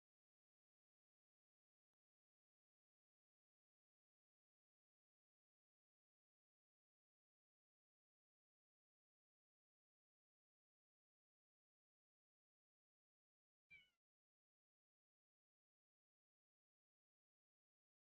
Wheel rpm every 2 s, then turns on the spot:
0, 0, 0, 0, 0, 0, 0, 0, 0.
none